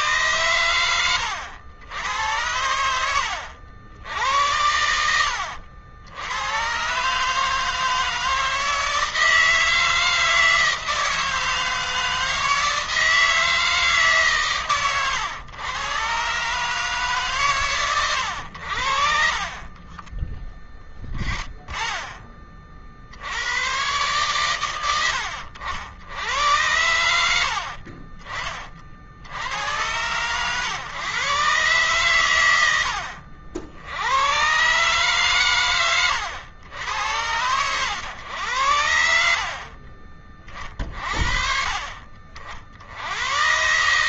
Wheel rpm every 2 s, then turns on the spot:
110, 90, 90, 130, 160, 160, 160, 120, 140, 60, 10, 50, 100, 90, 50, 110, 90, 130, 100, 70, 50, 60.
none